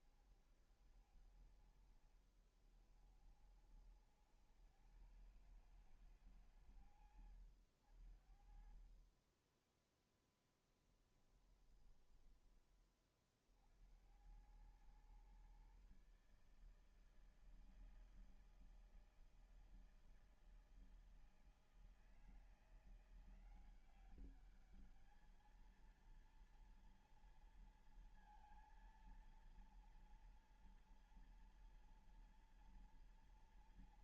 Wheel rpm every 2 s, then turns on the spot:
70, 50, 80, 100, 50, 10, 20, 90, 140, 160, 160, 160, 190, 230, 230, 230, 230.
none